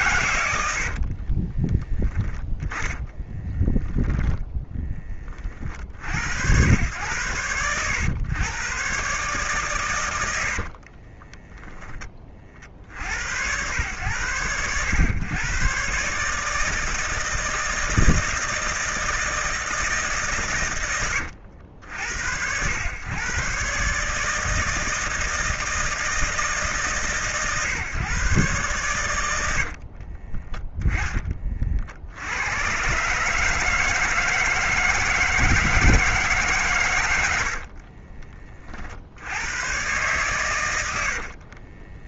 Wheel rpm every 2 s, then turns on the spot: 60, 10, 10, 100, 120, 40, 60, 100, 160, 160, 100, 100, 160, 150, 110, 10, 130, 160, 110, 50, 90.
0-4 10-12 40-42